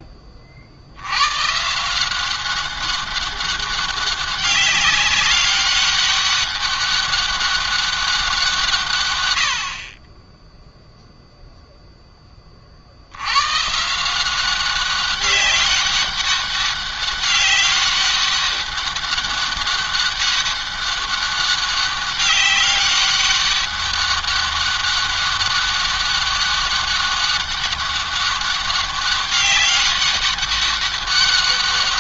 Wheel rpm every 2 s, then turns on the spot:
70, 190, 190, 190, 140, 0, 60, 190, 200, 200, 200, 200, 200, 200, 200, 200.
none